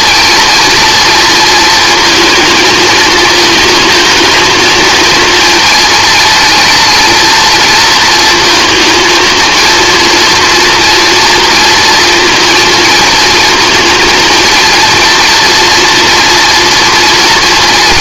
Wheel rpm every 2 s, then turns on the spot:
230, 220, 230, 230, 230, 230, 230, 230, 240.
none